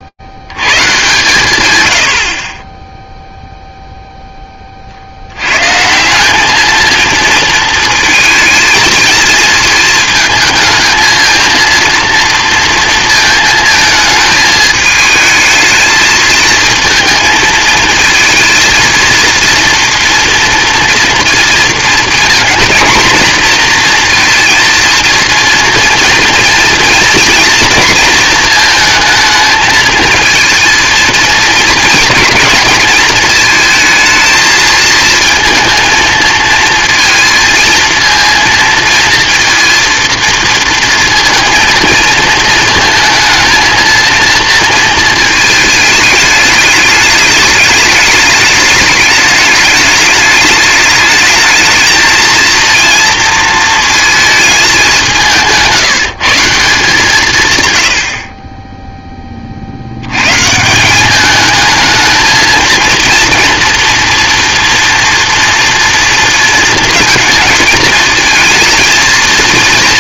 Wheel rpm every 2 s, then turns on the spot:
120, 0, 50, 220, 230, 220, 230, 210, 230, 230, 230, 220, 230, 230, 220, 230, 220, 220, 230, 230, 230, 220, 230, 210, 210, 210, 230, 190, 160, 10, 170, 230, 230, 230, 230.
none